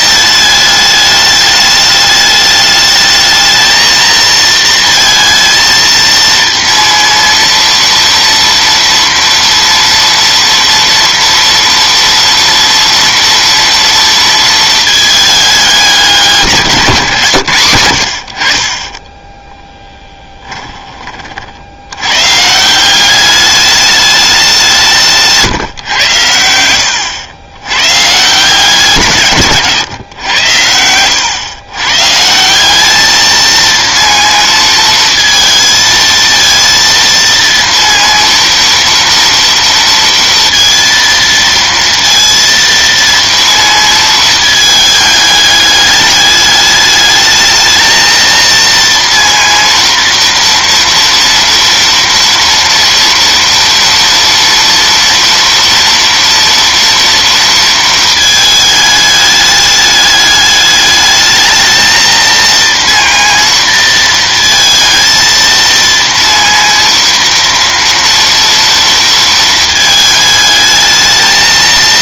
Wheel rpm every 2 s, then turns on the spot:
210, 210, 230, 230, 230, 240, 230, 230, 170, 50, 20, 150, 190, 90, 160, 110, 180, 230, 230, 230, 230, 230, 220, 210, 230, 230, 230, 230, 230, 220, 210, 230, 230, 230, 230, 220.
26-28